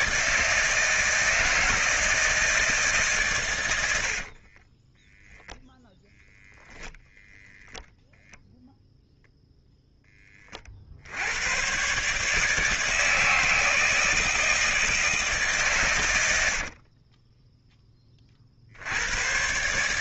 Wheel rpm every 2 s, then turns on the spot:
160, 160, 40, 0, 0, 40, 160, 160, 90, 60.
4-6 16-18